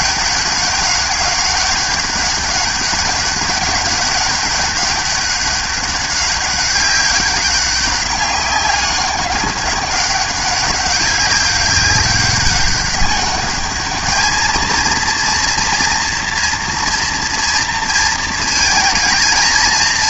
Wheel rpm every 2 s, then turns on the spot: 200, 200, 200, 190, 200, 200, 200, 220, 230, 220.
none